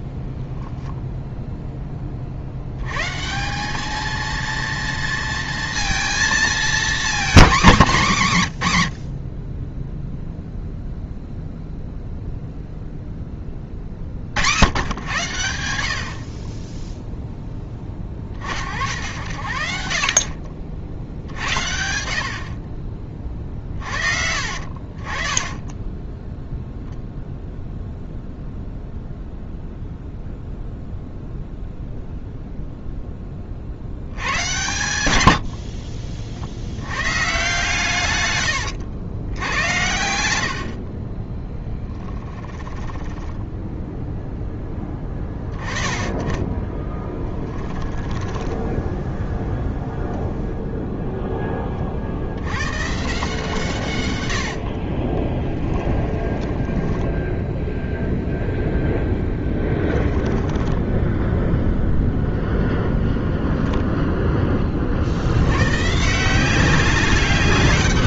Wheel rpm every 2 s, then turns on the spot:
10, 100, 230, 230, 100, 0, 0, 100, 10, 70, 60, 40, 40, 0, 0, 0, 0, 110, 100, 100, 40, 10, 10, 20, 10, 0, 130, 40, 10, 0, 10, 0, 40, 190.
0-2 42-44 46-50 54-58 60-62